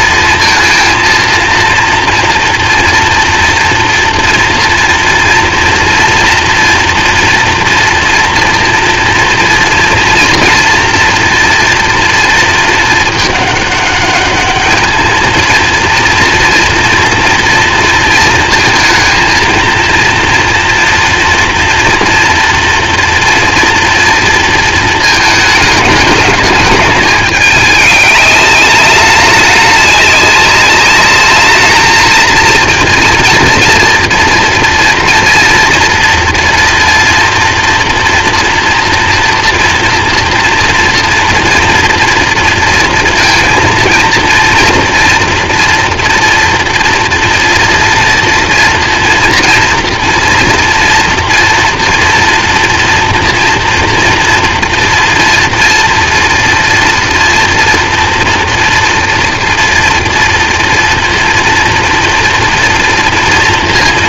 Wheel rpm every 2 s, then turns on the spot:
230, 240, 230, 230, 240, 230, 220, 210, 230, 230, 230, 230, 220, 210, 210, 200, 230, 240, 230, 230, 240, 230, 230, 240, 230, 230, 240, 240, 230, 230, 230, 230.
none